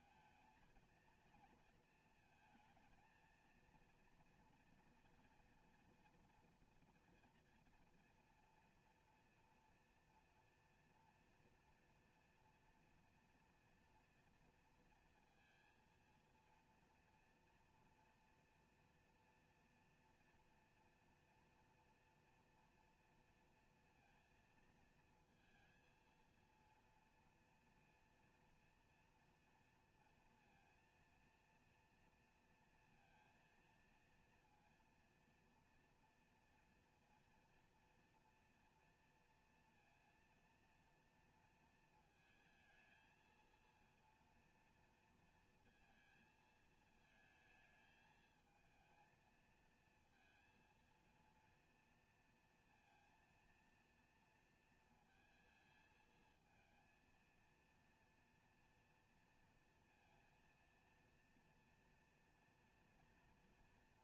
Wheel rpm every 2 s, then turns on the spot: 230, 230, 230, 230, 240, 230, 230, 230, 230, 240, 240, 240, 230, 230, 230, 230, 230, 230, 230, 230, 230, 220, 230, 230, 220, 230, 230, 230, 220, 230, 230, 230.
none